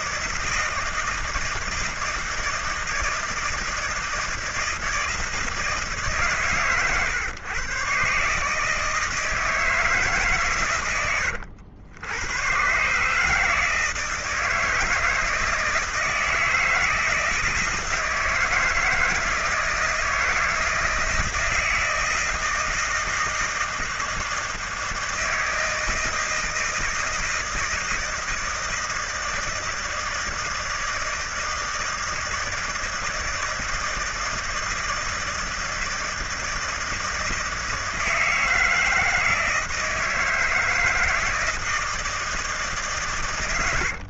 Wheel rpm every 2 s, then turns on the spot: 160, 160, 170, 120, 150, 110, 130, 160, 160, 160, 160, 160, 160, 160, 160, 160, 160, 160, 160, 160, 160, 150.
none